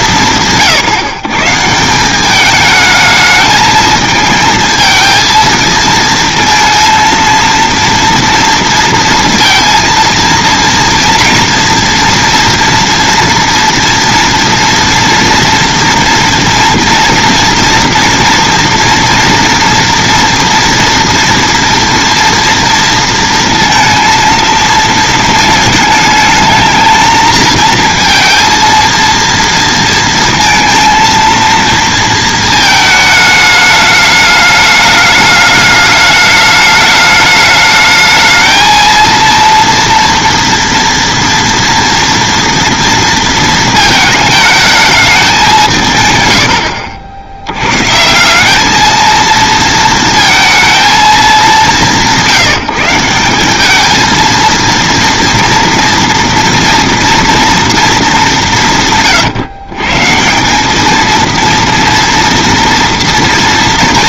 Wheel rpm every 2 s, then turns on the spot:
170, 210, 220, 230, 230, 230, 230, 230, 230, 230, 230, 230, 230, 220, 230, 230, 220, 210, 210, 220, 230, 230, 220, 90, 200, 220, 190, 230, 240, 180, 190, 240.
none